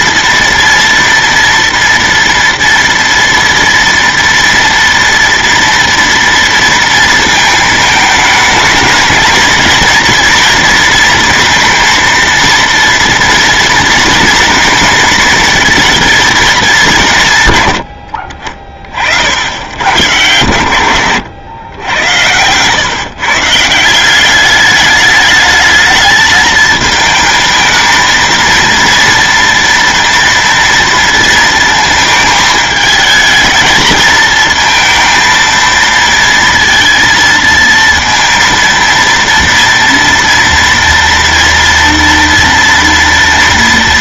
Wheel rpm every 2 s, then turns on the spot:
240, 230, 230, 230, 210, 230, 230, 230, 210, 50, 100, 120, 200, 220, 230, 230, 220, 220, 230, 230, 230, 230.
none